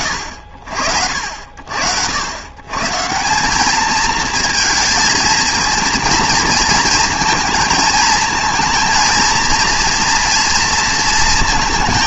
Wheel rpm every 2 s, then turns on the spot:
90, 120, 230, 230, 230, 230.
none